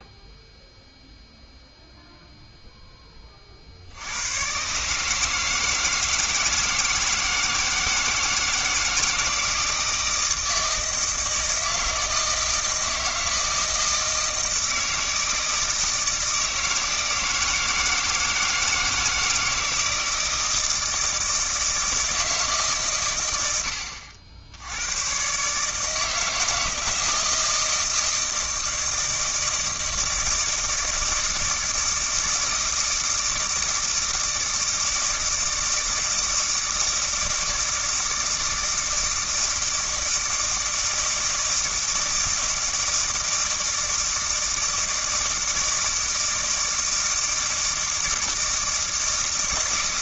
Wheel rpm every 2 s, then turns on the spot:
0, 0, 130, 160, 160, 160, 160, 160, 160, 160, 160, 150, 90, 160, 160, 160, 160, 160, 160, 160, 160, 160, 160, 160, 160.
none